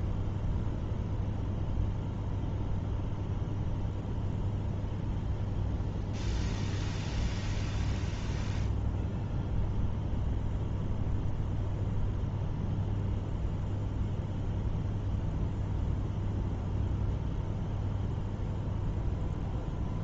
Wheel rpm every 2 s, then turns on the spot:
0, 0, 0, 0, 0, 0, 0, 0, 0, 0.
none